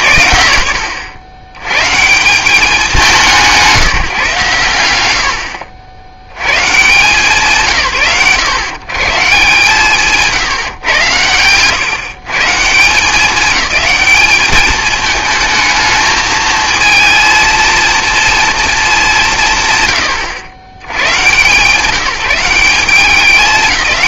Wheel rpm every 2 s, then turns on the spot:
110, 200, 120, 120, 120, 120, 170, 220, 230, 220, 120, 190.
none